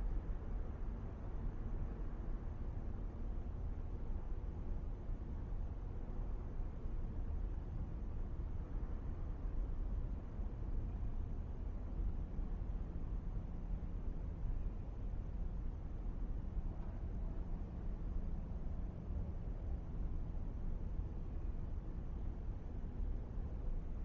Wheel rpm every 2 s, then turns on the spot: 0, 0, 0, 0, 0, 0, 0, 0, 0, 0, 0, 0.
none